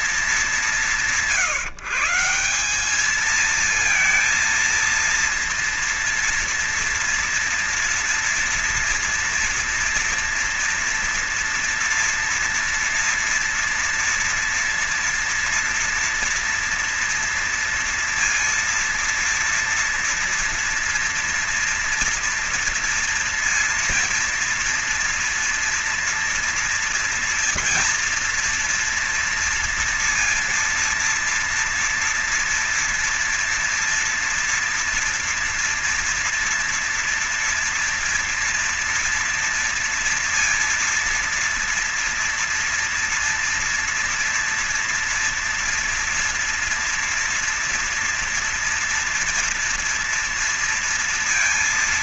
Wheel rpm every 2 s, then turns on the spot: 160, 230, 230, 230, 230, 230, 230, 230, 230, 230, 230, 230, 230, 240, 230, 230, 230, 230, 240, 240, 230, 230, 240, 230, 230, 230.
none